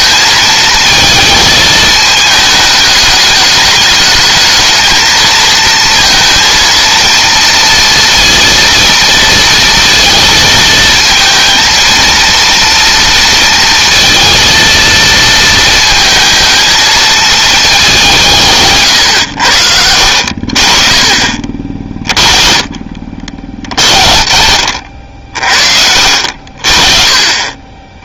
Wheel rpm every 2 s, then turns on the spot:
220, 210, 220, 230, 230, 230, 230, 230, 230, 150, 40, 40, 60, 40.
24-26